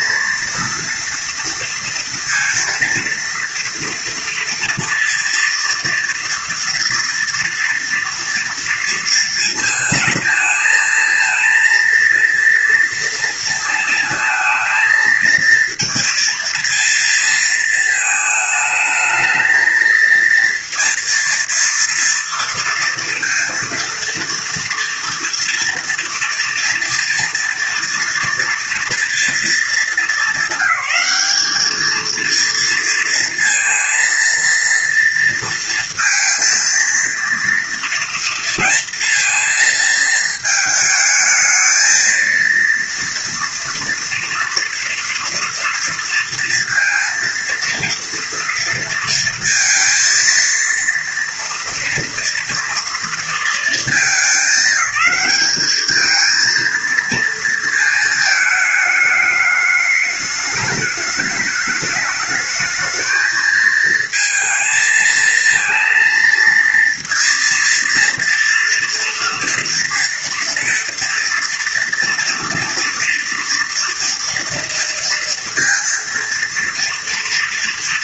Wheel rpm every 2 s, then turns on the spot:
230, 230, 230, 230, 230, 230, 230, 220, 230, 220, 230, 230, 230, 230, 230, 200, 230, 230, 230, 230, 220, 230, 230, 230, 230, 230, 230, 200, 230, 220, 210, 220, 230, 230, 230, 230, 230, 230, 230.
none